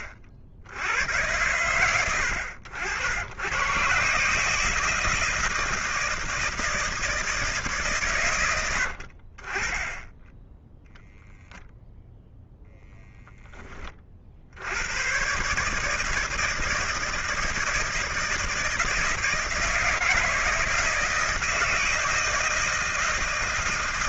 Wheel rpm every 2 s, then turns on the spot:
70, 80, 160, 160, 80, 0, 0, 100, 160, 160, 160, 160.
none